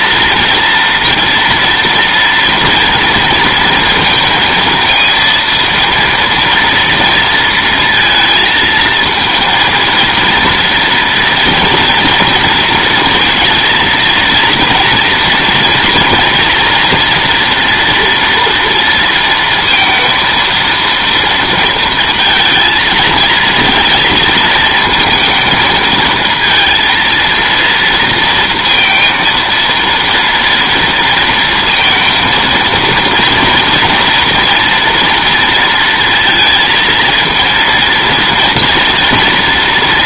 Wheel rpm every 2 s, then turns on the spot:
230, 230, 220, 230, 230, 230, 230, 230, 230, 230, 230, 220, 220, 230, 230, 230, 230, 230, 230, 240.
none